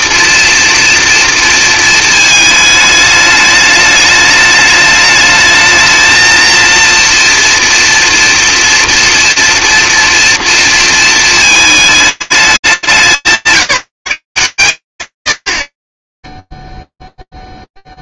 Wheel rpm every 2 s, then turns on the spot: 230, 210, 210, 230, 230, 230, 200, 110, 0.
none